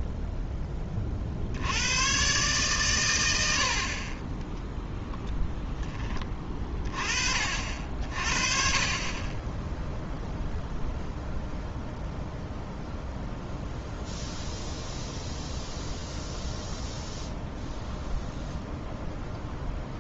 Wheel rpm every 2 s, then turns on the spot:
10, 120, 10, 20, 40, 0, 0, 0, 0, 0.
none